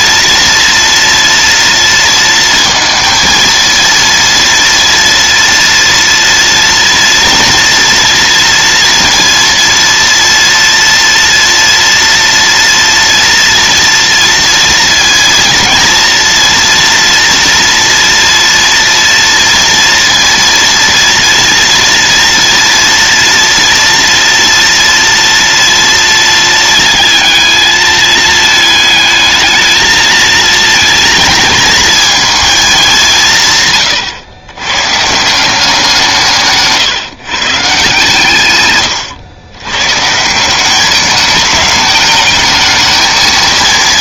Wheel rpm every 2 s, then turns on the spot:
230, 230, 230, 230, 230, 230, 230, 230, 230, 230, 230, 230, 240, 220, 220, 230, 200, 130, 150, 120, 200, 220.
38-40